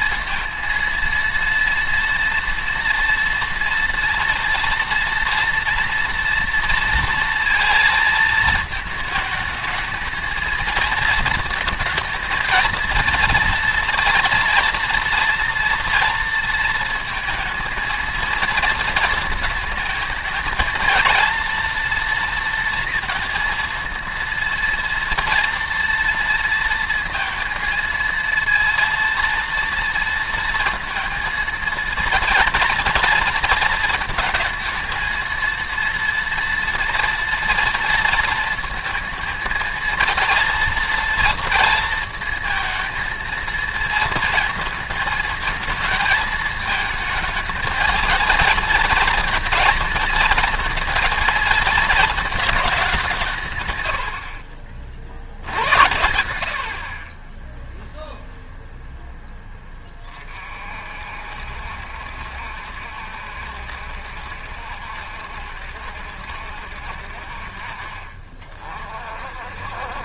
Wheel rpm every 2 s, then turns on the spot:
230, 230, 230, 230, 220, 230, 230, 230, 230, 230, 220, 230, 230, 230, 230, 230, 230, 230, 230, 230, 230, 230, 220, 220, 220, 230, 210, 60, 60, 0, 40, 70, 70, 60, 40.
none